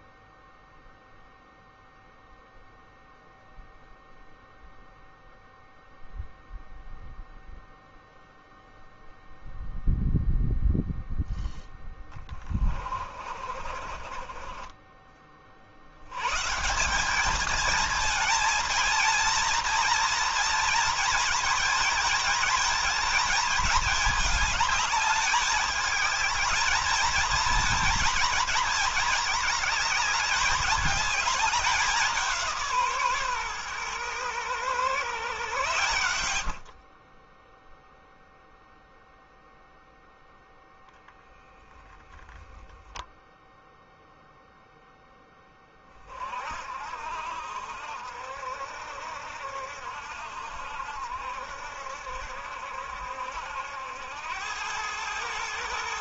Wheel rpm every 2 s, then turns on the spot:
0, 0, 0, 0, 0, 0, 30, 30, 190, 230, 220, 220, 210, 220, 230, 200, 150, 120, 40, 0, 0, 0, 0, 60, 60, 70, 70, 110.
12-14 36-38